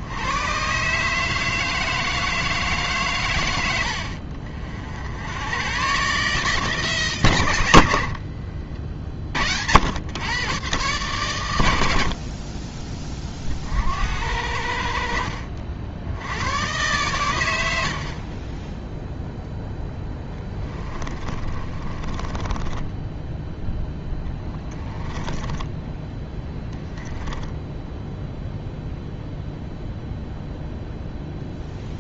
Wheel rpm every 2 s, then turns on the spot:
140, 140, 60, 150, 50, 130, 30, 70, 110, 10, 20, 10, 10, 20, 0, 0.
20-28